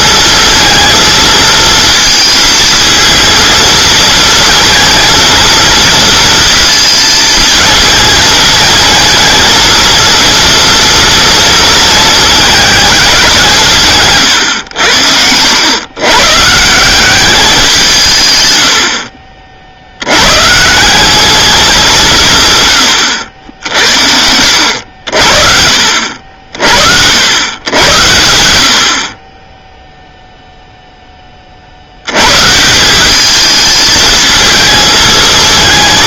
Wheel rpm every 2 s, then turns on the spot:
230, 220, 230, 230, 220, 230, 220, 90, 170, 90, 170, 120, 70, 60, 70, 0, 160, 220.
none